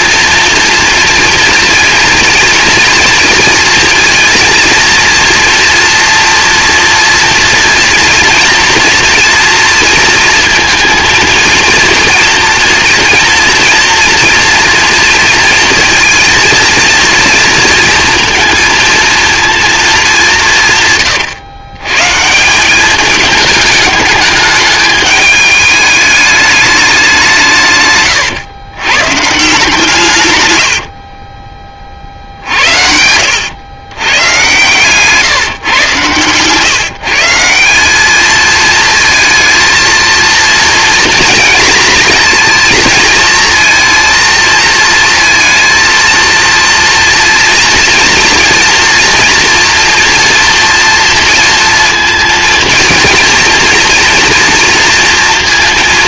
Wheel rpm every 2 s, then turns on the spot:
230, 230, 230, 240, 230, 230, 230, 230, 230, 230, 170, 170, 210, 210, 120, 100, 70, 120, 130, 220, 230, 230, 230, 230, 240, 240, 230, 230.
30-32